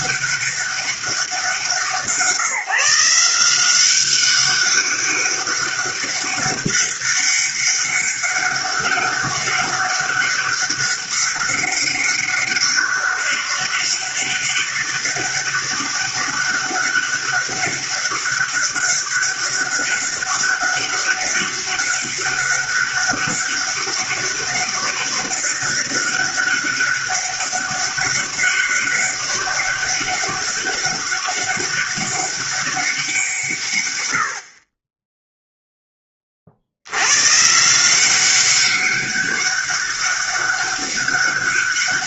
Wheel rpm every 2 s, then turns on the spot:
200, 170, 200, 200, 200, 200, 200, 200, 200, 200, 200, 200, 200, 200, 200, 200, 190, 20, 80, 200, 200.
none